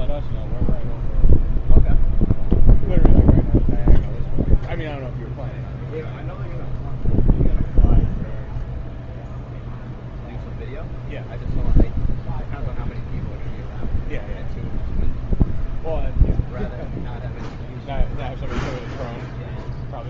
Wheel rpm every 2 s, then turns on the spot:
0, 0, 0, 0, 0, 0, 0, 0, 0, 0.
none